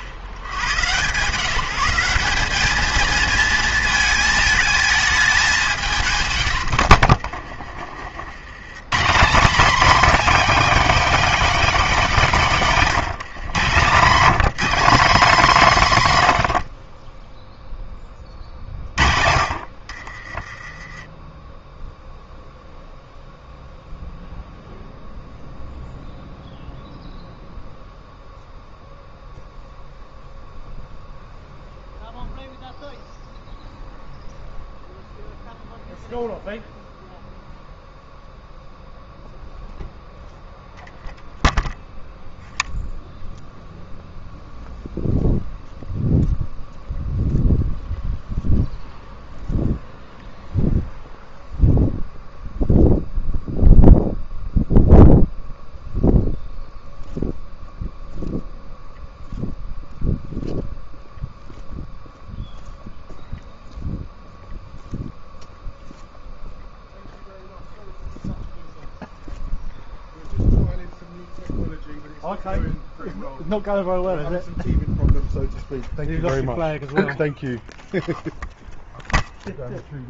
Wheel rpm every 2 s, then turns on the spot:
80, 210, 220, 100, 120, 270, 200, 210, 80, 50, 20, 0, 0, 0, 0, 0, 0, 0, 0, 0, 0, 0, 0, 0, 0, 0, 0, 0, 0, 0, 0, 0, 0, 0, 0, 0, 0, 0, 0, 0.
6-8 20-22